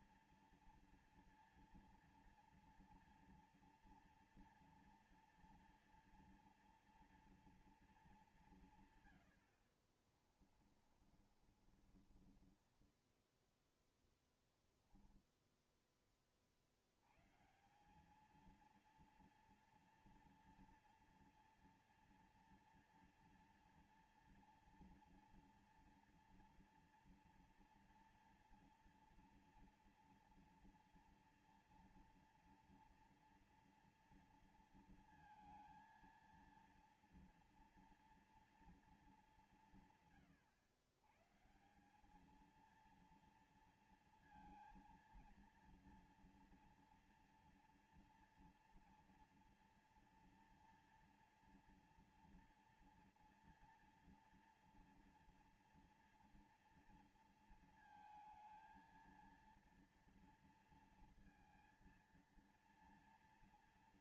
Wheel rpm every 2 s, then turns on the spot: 230, 230, 230, 230, 210, 60, 30, 10, 30, 200, 230, 230, 230, 230, 230, 230, 230, 230, 230, 230, 140, 200, 230, 230, 240, 230, 230, 230, 230, 220, 230, 230.
10-14